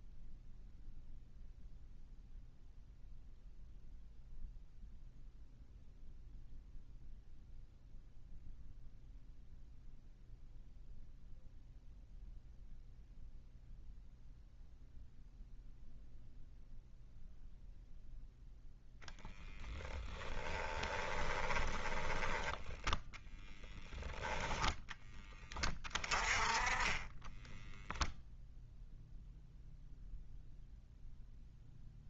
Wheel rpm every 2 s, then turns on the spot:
0, 0, 0, 0, 0, 0, 0, 0, 0, 0, 10, 10, 10, 20, 0, 0.
20-22